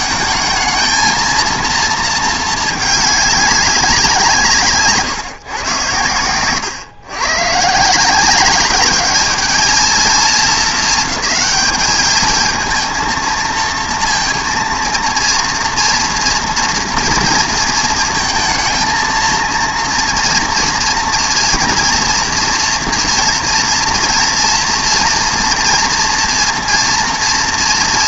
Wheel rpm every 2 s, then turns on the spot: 220, 220, 160, 120, 200, 210, 220, 230, 230, 220, 230, 230, 240, 230.
none